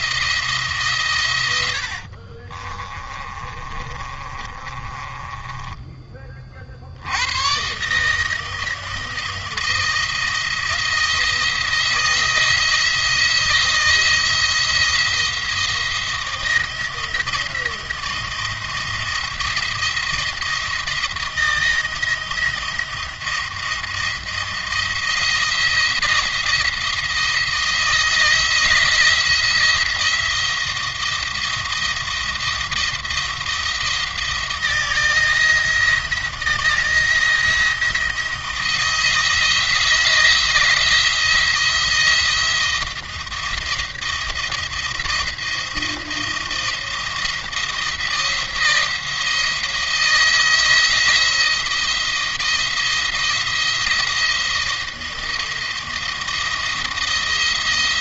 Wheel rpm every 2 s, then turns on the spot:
150, 30, 30, 70, 170, 170, 170, 170, 170, 170, 170, 170, 170, 170, 170, 170, 170, 160, 170, 170, 170, 170, 170, 170, 170, 170, 170, 170, 170.
2-6